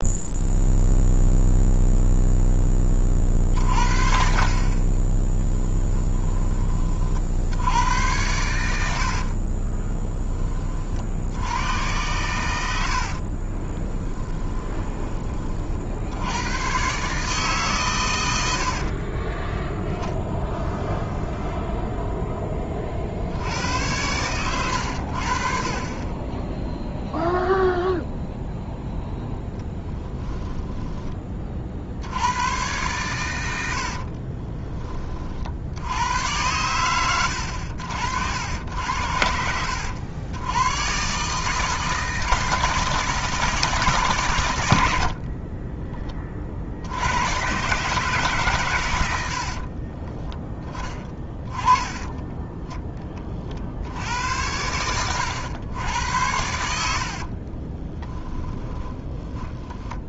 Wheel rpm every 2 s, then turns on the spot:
0, 20, 30, 30, 80, 40, 80, 20, 120, 60, 0, 30, 100, 0, 0, 10, 110, 20, 110, 80, 110, 160, 90, 60, 120, 20, 20, 90, 80, 10.
12-14 18-20 50-52 54-60